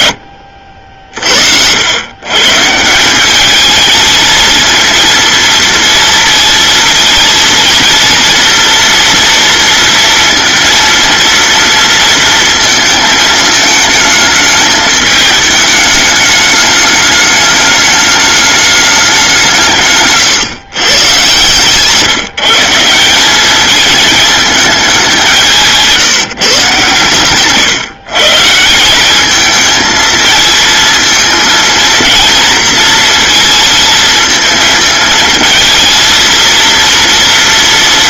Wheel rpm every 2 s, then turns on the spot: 50, 160, 230, 230, 240, 230, 220, 210, 210, 200, 130, 170, 200, 130, 180, 230, 230, 220, 230.
none